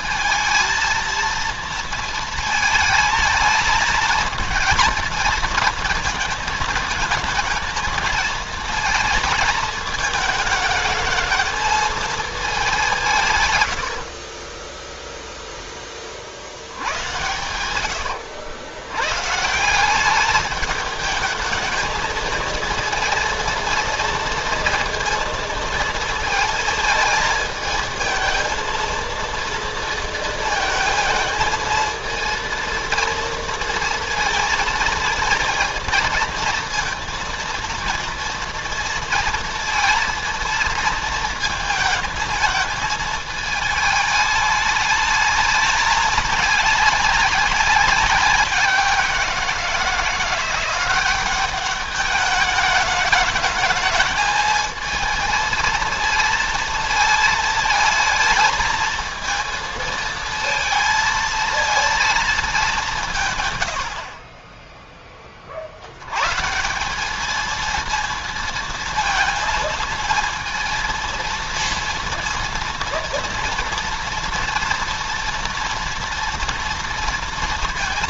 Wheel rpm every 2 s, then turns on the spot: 220, 220, 230, 230, 230, 220, 190, 10, 60, 100, 210, 230, 230, 220, 220, 220, 230, 230, 230, 230, 230, 220, 210, 210, 190, 180, 210, 220, 230, 220, 230, 200, 30, 180, 230, 230, 230, 230, 230.
14-16